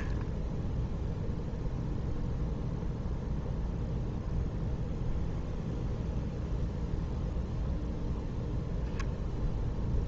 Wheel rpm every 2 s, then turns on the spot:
0, 0, 0, 0, 0.
none